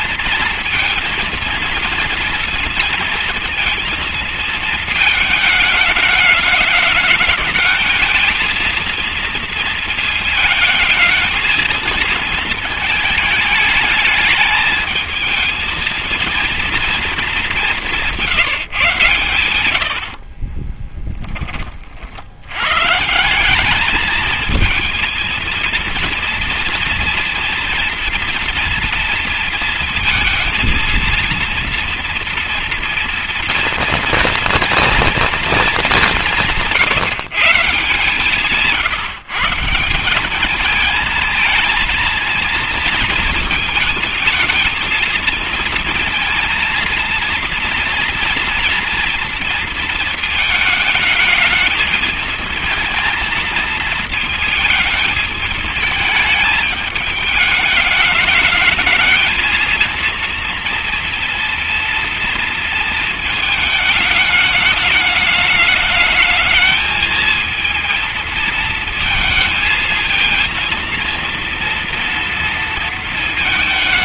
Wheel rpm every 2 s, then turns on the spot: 230, 230, 220, 210, 220, 220, 220, 220, 230, 150, 40, 100, 220, 230, 230, 230, 230, 230, 180, 150, 200, 230, 230, 230, 230, 220, 230, 220, 220, 220, 230, 230, 210, 220, 230, 230, 230.
20-22